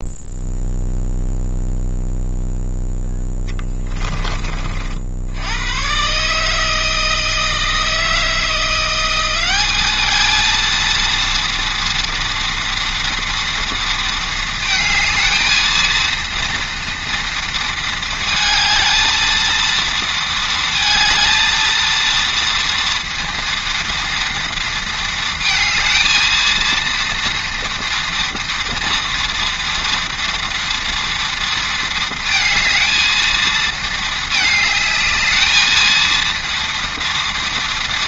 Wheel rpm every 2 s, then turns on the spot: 0, 0, 50, 160, 170, 230, 230, 220, 230, 220, 230, 230, 230, 230, 230, 230, 220, 220, 230.
none